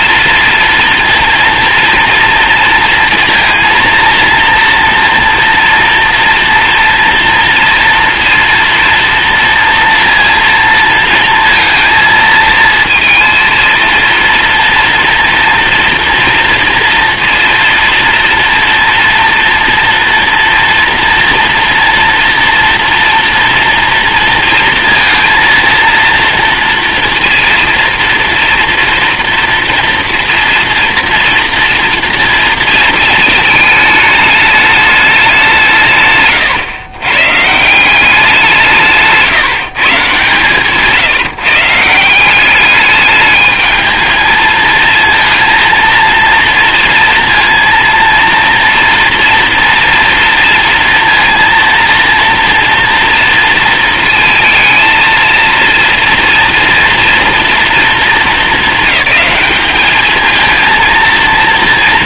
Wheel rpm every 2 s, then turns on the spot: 230, 230, 230, 230, 230, 230, 230, 240, 230, 230, 240, 230, 230, 230, 230, 230, 220, 210, 110, 160, 140, 210, 220, 230, 230, 230, 230, 230, 230, 220, 230.
none